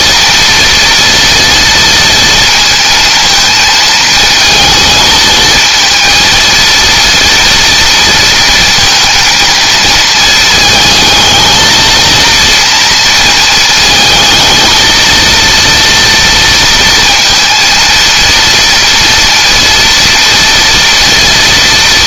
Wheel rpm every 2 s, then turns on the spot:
230, 230, 220, 230, 230, 220, 230, 220, 230, 230, 230.
none